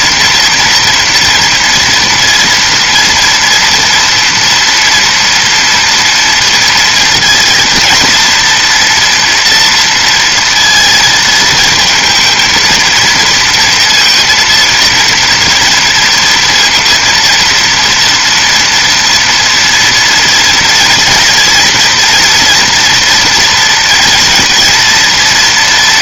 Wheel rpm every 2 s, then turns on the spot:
240, 230, 240, 230, 230, 230, 220, 230, 230, 240, 230, 240, 230.
none